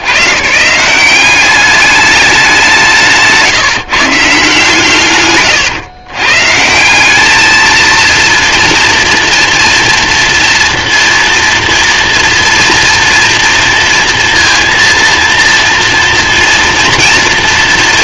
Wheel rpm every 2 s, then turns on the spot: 130, 190, 130, 160, 230, 230, 230, 230, 230.
none